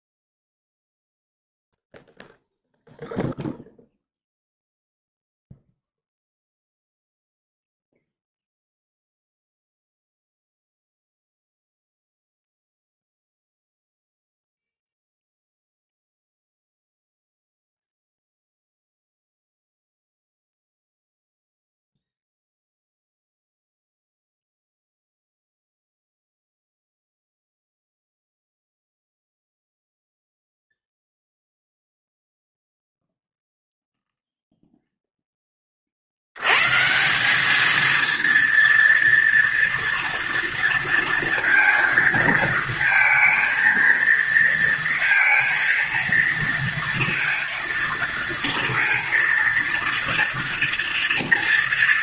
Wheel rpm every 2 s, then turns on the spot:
0, 0, 0, 0, 0, 0, 0, 0, 0, 0, 0, 0, 0, 0, 0, 0, 0, 0, 100, 230, 230, 230, 230, 230, 230, 230.
none